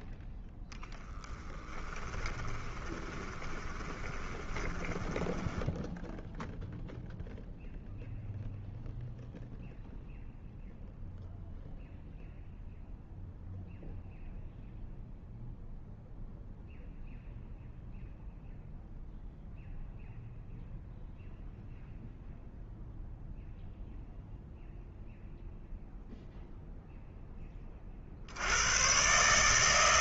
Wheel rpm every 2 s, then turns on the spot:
0, 10, 20, 0, 0, 0, 0, 0, 0, 0, 0, 0, 0, 0, 80.
2-6